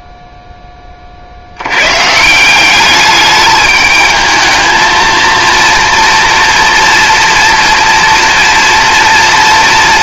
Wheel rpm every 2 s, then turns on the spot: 10, 190, 220, 240, 230.
none